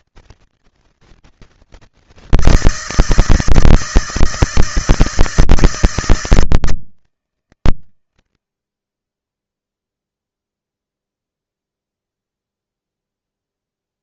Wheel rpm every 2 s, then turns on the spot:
160, 160, 160, 160, 50, 0, 0.
none